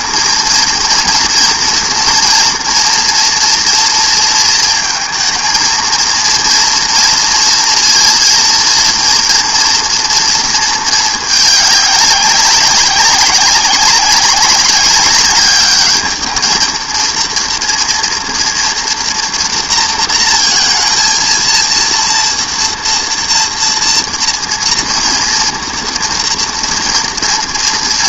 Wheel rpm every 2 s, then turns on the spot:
230, 240, 230, 230, 230, 220, 200, 200, 230, 230, 230, 230, 230, 230.
none